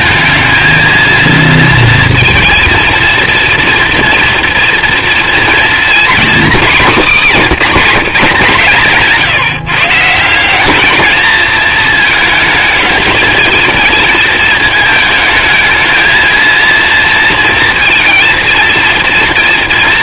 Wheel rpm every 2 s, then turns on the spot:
230, 230, 230, 240, 150, 220, 220, 220, 230, 230.
none